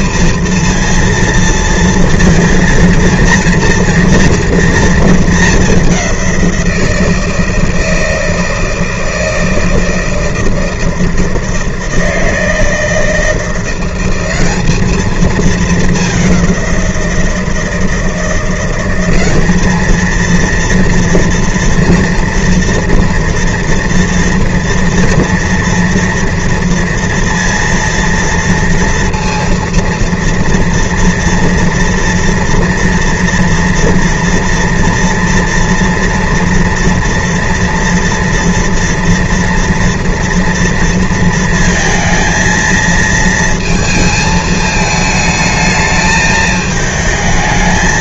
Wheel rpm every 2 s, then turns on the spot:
230, 230, 230, 180, 160, 160, 160, 190, 190, 170, 230, 230, 240, 230, 230, 230, 230, 230, 230, 240, 240, 220, 220, 220.
none